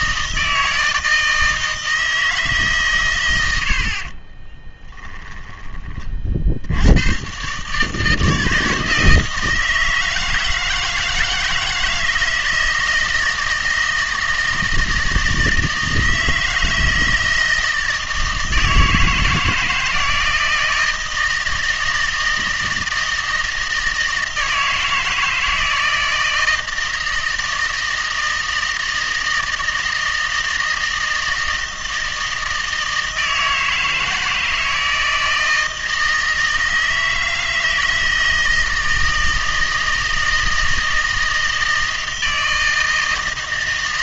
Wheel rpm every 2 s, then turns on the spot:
160, 140, 20, 70, 160, 160, 160, 160, 160, 160, 160, 160, 160, 160, 160, 160, 160, 160, 160, 160, 160, 160.
4-6